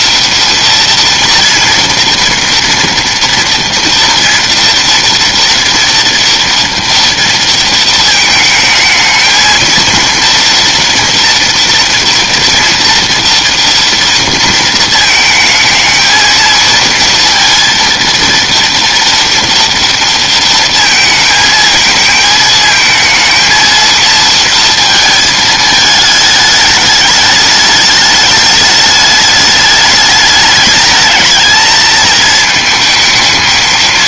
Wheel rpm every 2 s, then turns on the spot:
230, 230, 230, 230, 220, 230, 230, 230, 230, 230, 230, 220, 230, 210, 210, 210, 220.
none